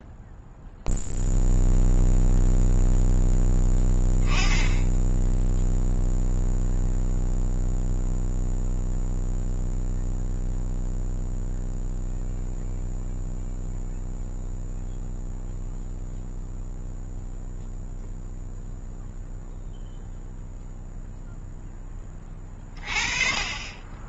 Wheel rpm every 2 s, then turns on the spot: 0, 0, 10, 0, 0, 0, 0, 0, 0, 0, 0, 30.
none